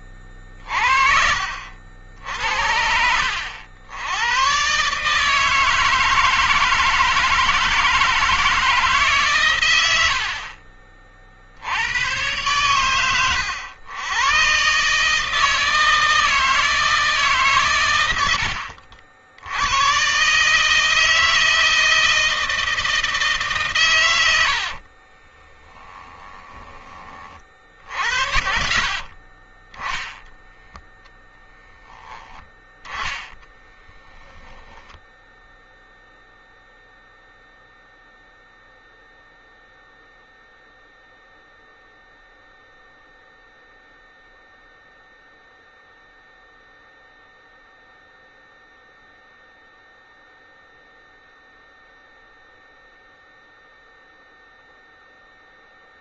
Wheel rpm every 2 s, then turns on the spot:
50, 80, 140, 160, 150, 40, 110, 140, 150, 60, 160, 160, 40, 20, 50, 0, 10, 0, 0, 0, 0, 0, 0, 0, 0, 0, 0, 0.
12-14 24-26 28-30 32-34